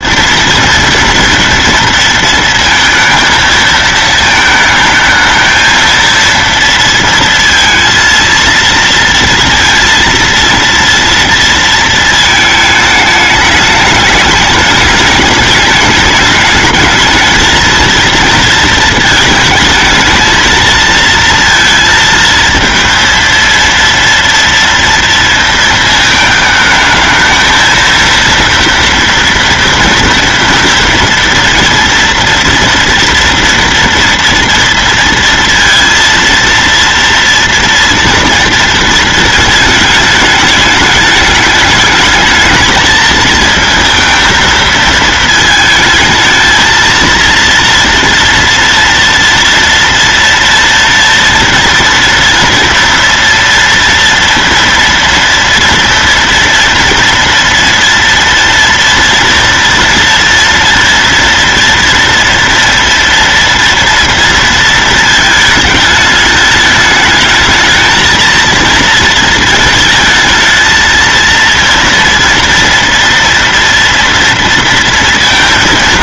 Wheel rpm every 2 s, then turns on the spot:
230, 220, 220, 230, 230, 230, 210, 210, 220, 220, 230, 230, 230, 220, 230, 230, 230, 230, 230, 230, 210, 220, 220, 230, 230, 230, 230, 230, 230, 230, 230, 230, 220, 210, 230, 220, 230, 230.
none